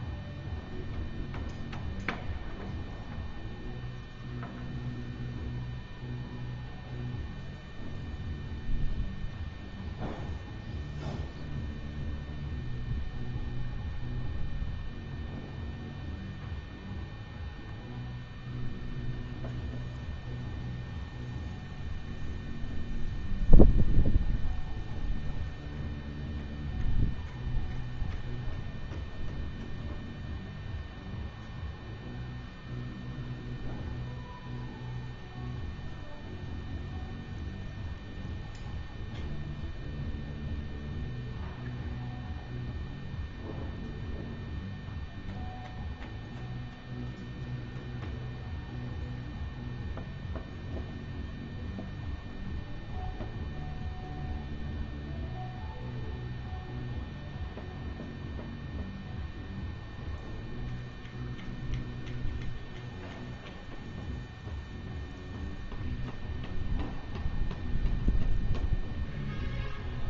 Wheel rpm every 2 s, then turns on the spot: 0, 0, 0, 0, 0, 0, 0, 0, 0, 0, 0, 0, 0, 0, 0, 0, 0, 0, 0, 0, 0, 0, 0, 0, 0, 0, 0, 0, 0, 0, 0, 0, 0, 0, 0.
none